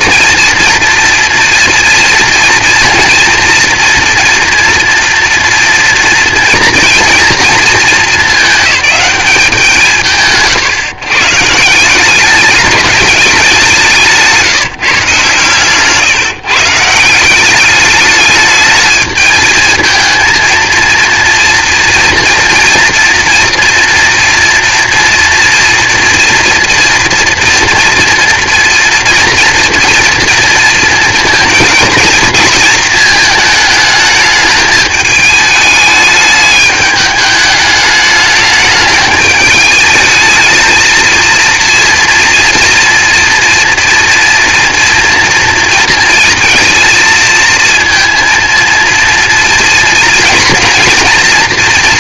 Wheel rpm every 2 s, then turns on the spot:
230, 240, 230, 230, 210, 140, 190, 160, 150, 210, 230, 230, 230, 230, 230, 230, 230, 210, 210, 210, 220, 230, 230, 230, 230, 230.
none